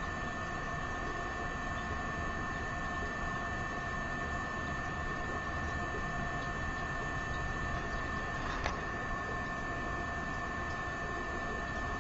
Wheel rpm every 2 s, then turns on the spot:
0, 0, 0, 0, 0, 0.
none